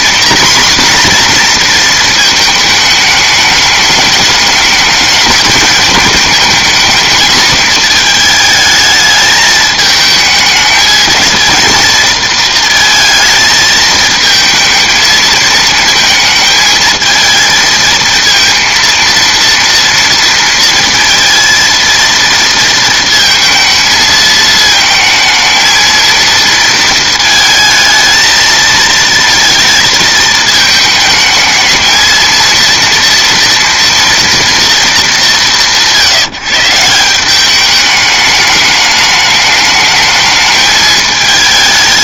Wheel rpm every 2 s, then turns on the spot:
250, 220, 210, 220, 220, 210, 230, 220, 220, 230, 230, 230, 220, 230, 220, 220, 230, 230, 160, 210, 220.
none